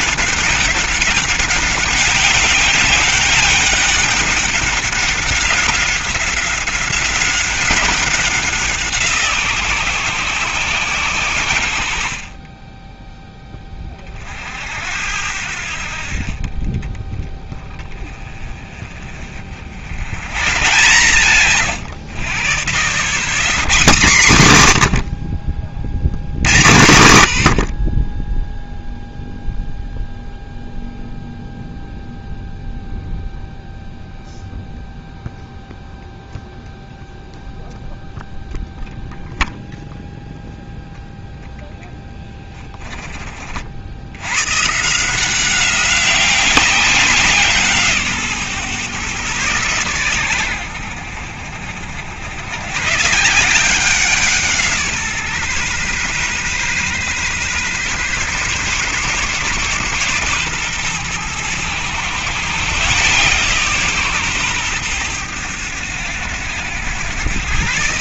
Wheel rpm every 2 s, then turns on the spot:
190, 200, 200, 190, 180, 130, 20, 70, 20, 30, 140, 60, 120, 90, 0, 0, 0, 0, 0, 0, 0, 10, 140, 190, 130, 90, 130, 160, 130, 140, 120, 140, 120, 100.
none